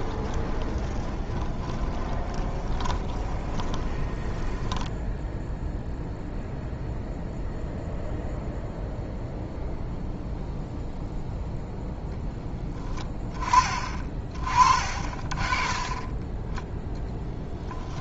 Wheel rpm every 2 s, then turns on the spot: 20, 20, 20, 0, 0, 0, 10, 40, 10.
0-6